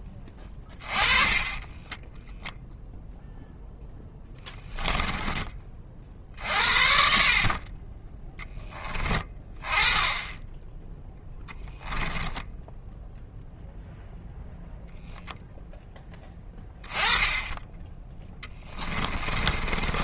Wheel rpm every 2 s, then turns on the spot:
20, 0, 20, 50, 10, 10, 10, 0, 20, 20.
0-2 4-6 18-20